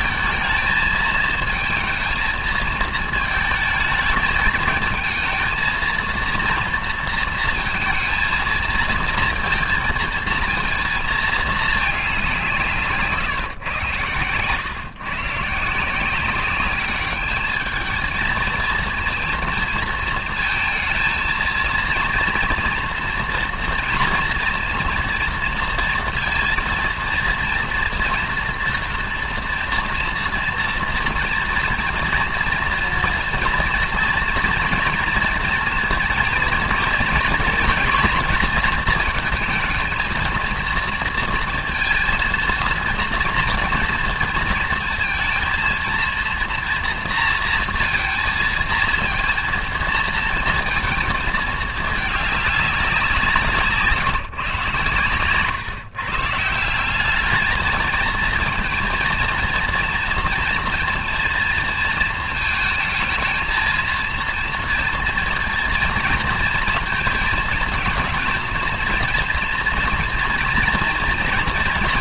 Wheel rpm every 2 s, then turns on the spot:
220, 220, 220, 230, 230, 230, 170, 130, 200, 230, 230, 230, 230, 230, 230, 230, 230, 230, 230, 220, 230, 230, 230, 230, 230, 230, 200, 130, 170, 230, 230, 220, 230, 230, 230, 230.
none